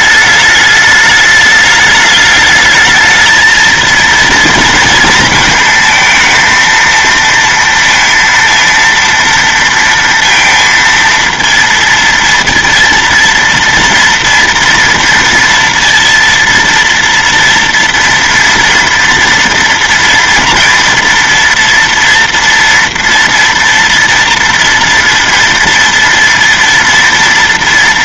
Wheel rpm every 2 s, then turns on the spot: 210, 220, 220, 230, 230, 230, 230, 230, 230, 230, 230, 230, 230, 230.
none